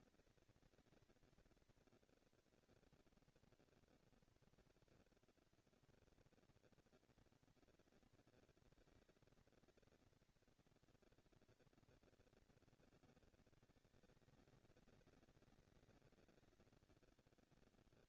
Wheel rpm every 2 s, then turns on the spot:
220, 230, 230, 230, 220, 230, 220, 200, 200.
none